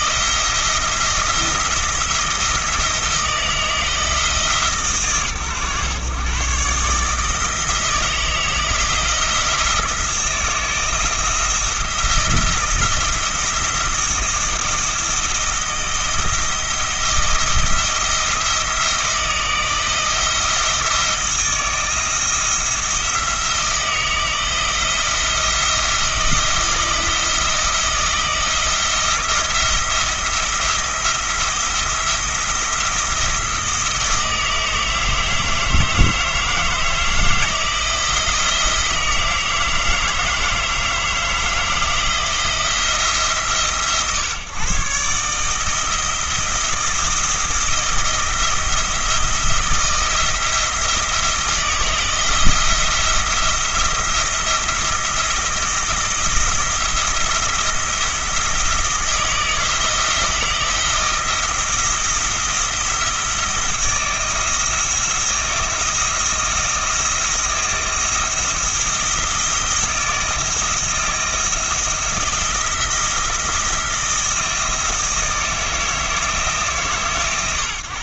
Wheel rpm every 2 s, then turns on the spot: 160, 160, 140, 140, 170, 160, 170, 170, 160, 160, 160, 170, 170, 170, 170, 170, 170, 160, 160, 160, 160, 170, 140, 160, 160, 170, 170, 170, 170, 160, 160, 170, 170, 170, 160, 160, 170, 160, 140.
none